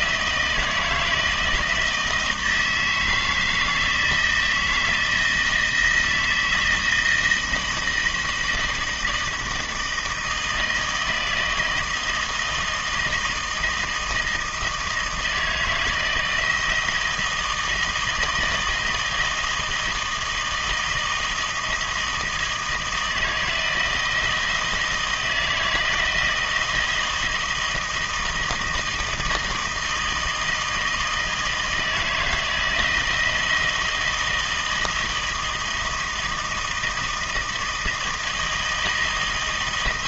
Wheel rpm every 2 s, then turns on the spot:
160, 160, 160, 160, 170, 160, 160, 160, 160, 160, 160, 160, 160, 160, 160, 160, 170, 160, 160, 160.
none